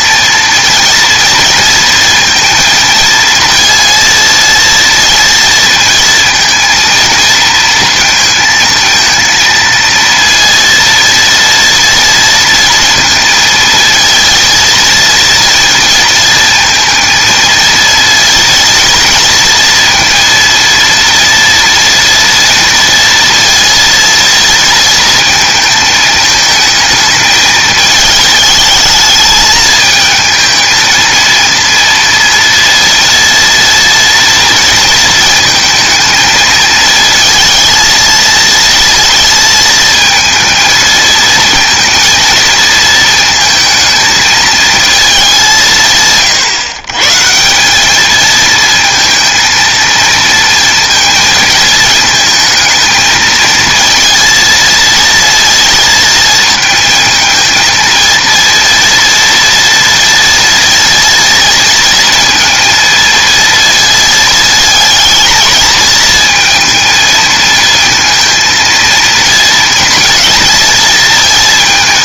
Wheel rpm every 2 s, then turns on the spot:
230, 230, 230, 230, 220, 230, 230, 230, 230, 230, 230, 230, 230, 220, 220, 220, 230, 230, 220, 230, 220, 230, 220, 130, 220, 230, 220, 230, 230, 230, 230, 230, 220, 230, 230, 230.
none